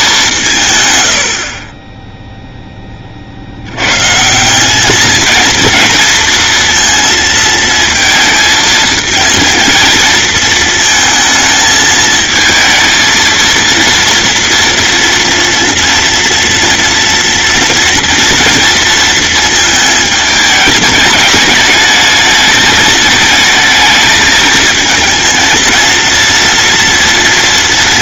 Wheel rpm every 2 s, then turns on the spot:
120, 20, 200, 230, 220, 220, 220, 230, 230, 230, 210, 220, 220, 230.
none